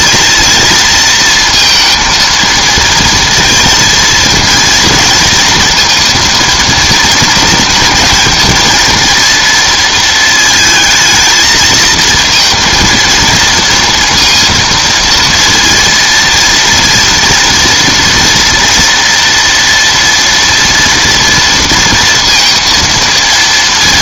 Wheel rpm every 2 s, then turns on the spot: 230, 230, 230, 230, 230, 220, 230, 230, 230, 230, 230, 230.
none